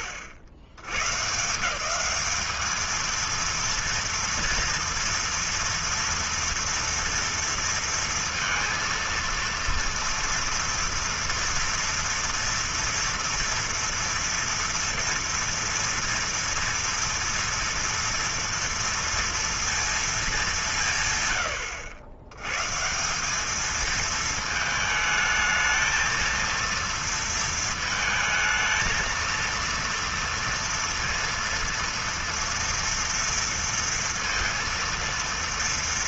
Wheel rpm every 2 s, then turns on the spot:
90, 220, 230, 230, 230, 230, 230, 230, 230, 230, 150, 150, 220, 230, 230, 230, 230, 230.
none